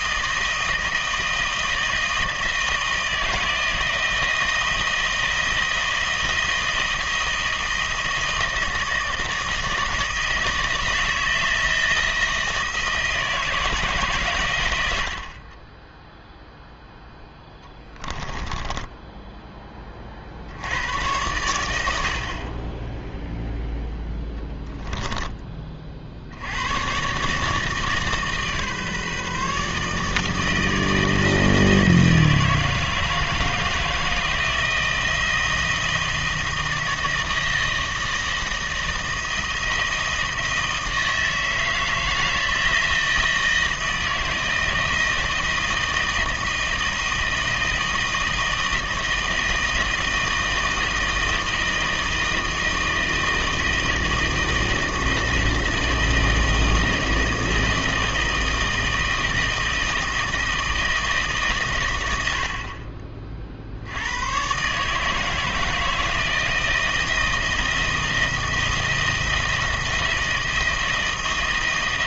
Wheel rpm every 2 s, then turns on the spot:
160, 160, 160, 160, 160, 160, 160, 100, 0, 10, 80, 20, 10, 100, 150, 160, 160, 160, 160, 160, 160, 160, 160, 160, 160, 160, 160, 160, 160, 160, 160, 50, 140, 160, 160, 160.
none